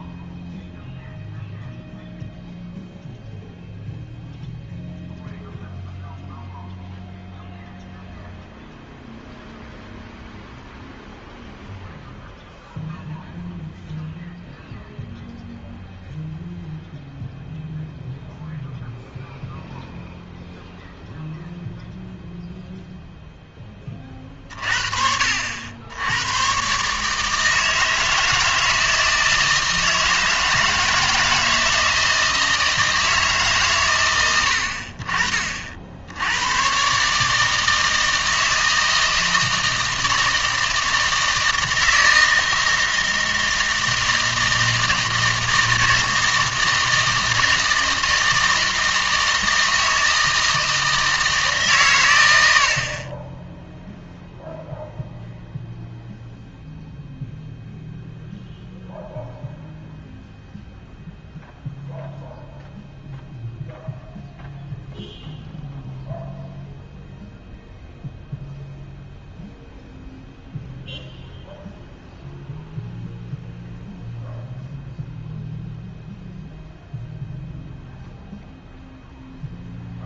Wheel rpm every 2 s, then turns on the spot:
0, 0, 0, 0, 0, 0, 0, 0, 0, 0, 0, 0, 40, 130, 160, 160, 160, 80, 110, 160, 160, 160, 160, 160, 160, 160, 60, 0, 0, 0, 0, 0, 0, 0, 0, 0, 0, 0, 0, 0.
none